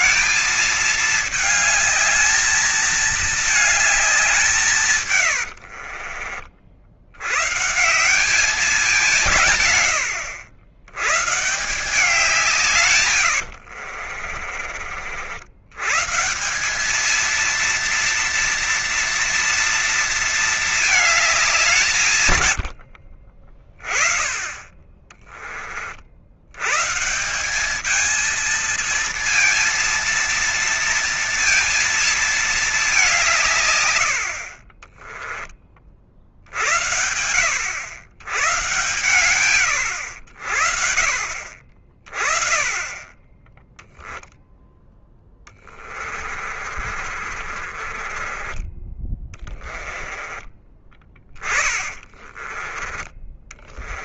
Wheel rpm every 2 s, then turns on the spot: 220, 220, 170, 50, 190, 110, 160, 50, 180, 230, 220, 100, 20, 110, 220, 230, 210, 40, 60, 110, 70, 30, 0, 40, 20, 20, 20.
24-26 34-36 46-48